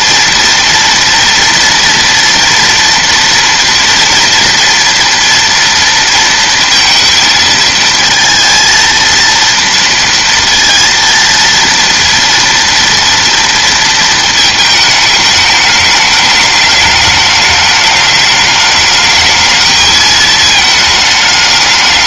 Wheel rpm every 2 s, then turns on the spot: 230, 240, 240, 230, 230, 230, 230, 220, 210, 210, 220.
none